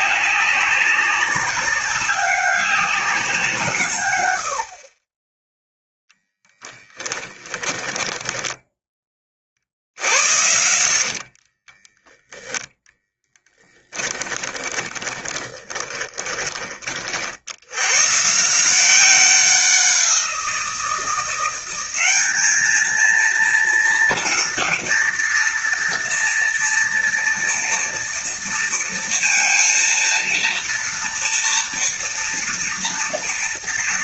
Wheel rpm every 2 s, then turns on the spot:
190, 190, 50, 10, 10, 70, 10, 20, 30, 170, 170, 220, 230, 230, 230, 230, 240.
6-8 10-12 14-16